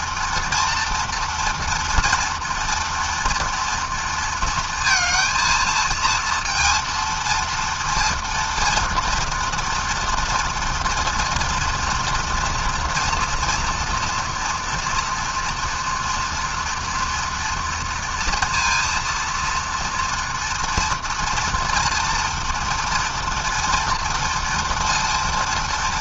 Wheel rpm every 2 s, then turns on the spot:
230, 240, 230, 230, 230, 240, 230, 230, 230, 230, 230, 230, 230.
none